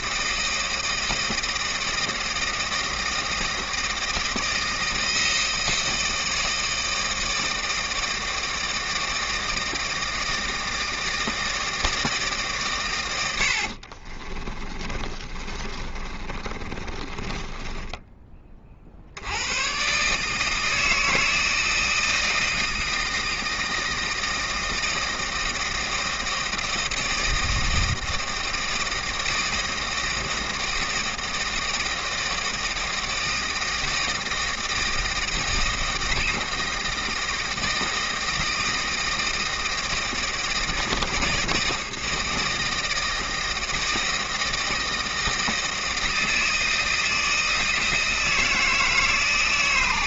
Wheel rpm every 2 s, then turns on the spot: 160, 160, 160, 160, 160, 160, 120, 30, 30, 40, 160, 160, 160, 170, 160, 160, 160, 160, 160, 160, 160, 160, 160, 160, 160.
14-18